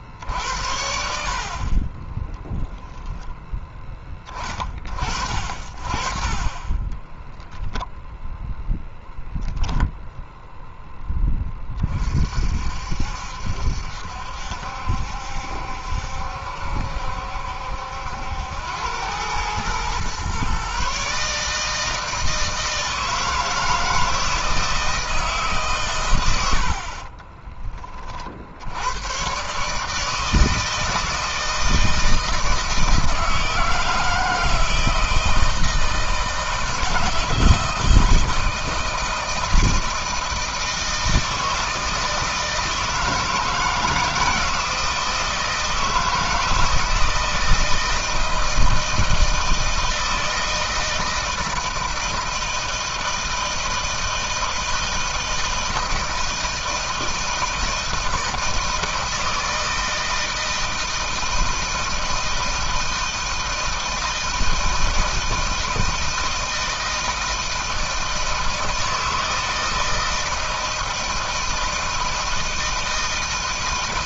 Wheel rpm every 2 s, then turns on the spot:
60, 0, 40, 20, 10, 10, 60, 70, 70, 100, 140, 160, 160, 50, 110, 160, 160, 160, 160, 160, 160, 160, 160, 160, 160, 160, 160, 160, 160, 160, 160, 160, 160, 160, 160, 160, 160.
6-8 26-28